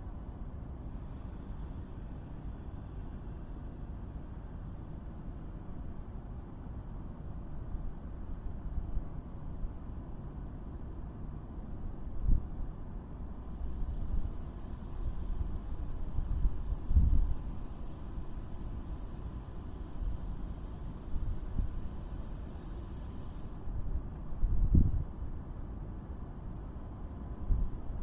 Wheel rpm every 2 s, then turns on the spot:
0, 0, 0, 0, 0, 0, 0, 0, 0, 0, 0, 0, 0, 0.
none